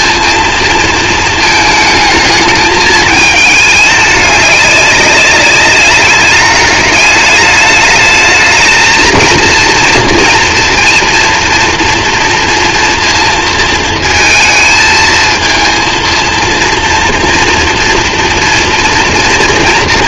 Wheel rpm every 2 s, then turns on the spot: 230, 220, 210, 200, 210, 230, 230, 220, 230, 230.
none